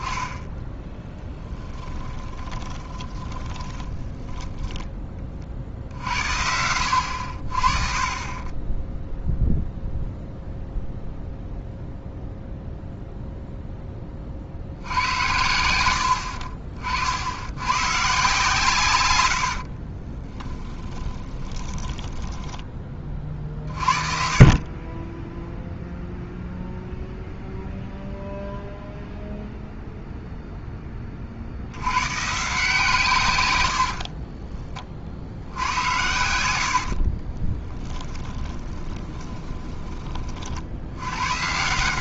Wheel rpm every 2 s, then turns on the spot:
20, 30, 10, 80, 10, 0, 0, 70, 60, 120, 20, 20, 30, 0, 0, 10, 150, 30, 80, 10, 70.
0-4 20-22 36-40